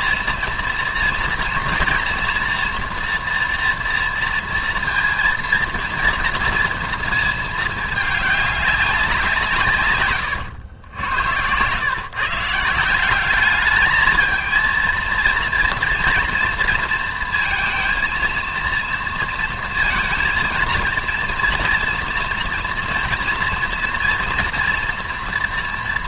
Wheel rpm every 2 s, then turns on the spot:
230, 230, 230, 230, 190, 90, 180, 230, 230, 230, 230, 240, 240.
none